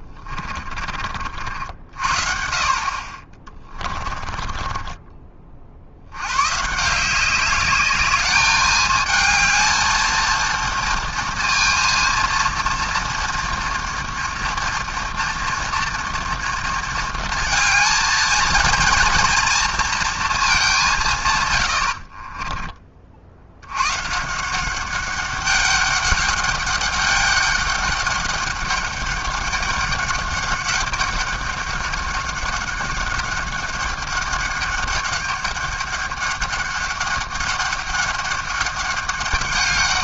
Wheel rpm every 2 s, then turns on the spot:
50, 40, 30, 190, 220, 230, 230, 230, 220, 230, 130, 60, 200, 200, 200, 200, 200, 200, 200, 200.
none